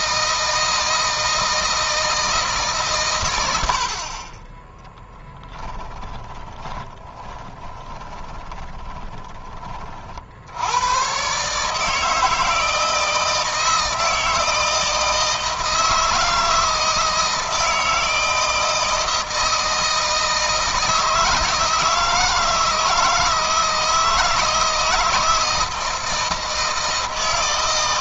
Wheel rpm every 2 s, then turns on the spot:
160, 140, 10, 20, 20, 110, 160, 160, 160, 160, 160, 160, 160, 160.
4-10